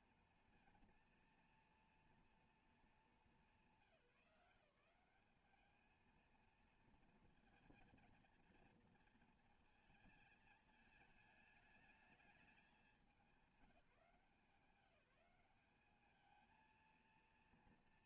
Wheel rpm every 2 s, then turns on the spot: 230, 230, 170, 230, 230, 220, 210, 180, 220.
none